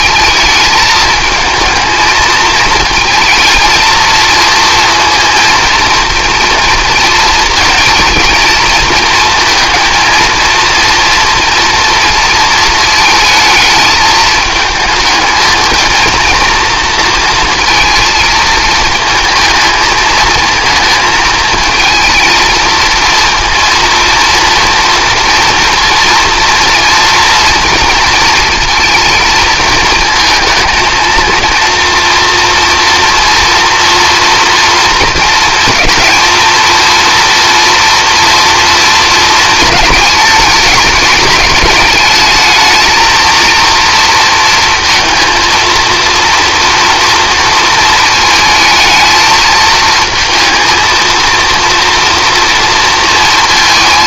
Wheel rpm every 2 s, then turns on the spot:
220, 220, 230, 230, 230, 230, 220, 220, 230, 220, 220, 230, 230, 230, 230, 230, 230, 230, 230, 230, 210, 220, 230, 240, 220, 220, 230.
none